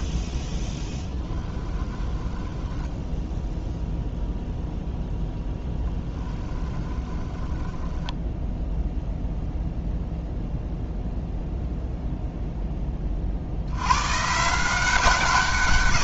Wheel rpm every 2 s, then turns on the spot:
10, 0, 0, 10, 0, 0, 50, 150.
0-2 6-8